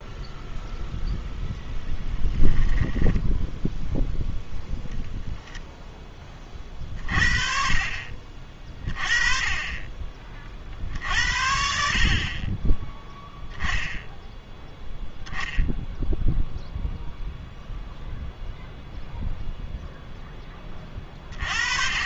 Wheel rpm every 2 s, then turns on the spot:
0, 10, 0, 30, 30, 50, 20, 0, 0, 0, 20.
2-4